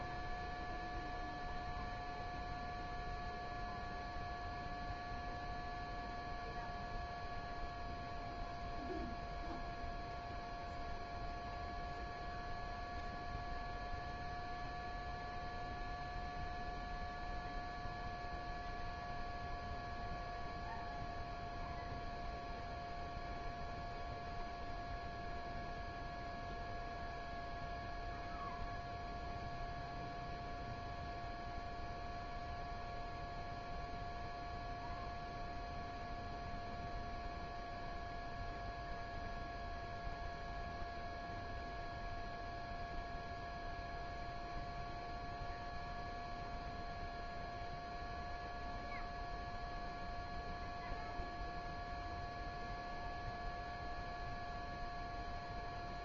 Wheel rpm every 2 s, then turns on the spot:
0, 0, 0, 0, 0, 0, 0, 0, 0, 0, 0, 0, 0, 0, 0, 0, 0, 0, 0, 0, 0, 0, 0, 0, 0, 0, 0, 0.
none